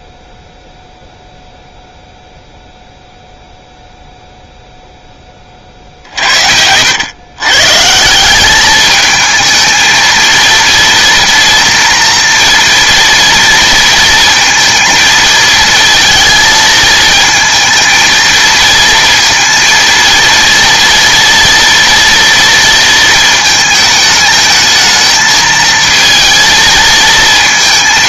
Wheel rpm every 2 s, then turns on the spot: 0, 0, 0, 80, 210, 230, 230, 230, 220, 230, 230, 230, 220, 230.
none